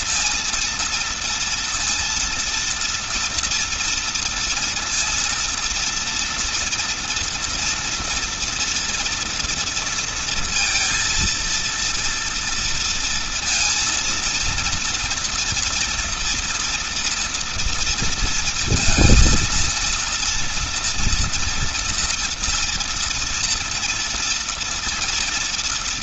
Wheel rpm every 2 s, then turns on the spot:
230, 230, 230, 230, 230, 230, 230, 240, 230, 230, 230, 230, 230.
none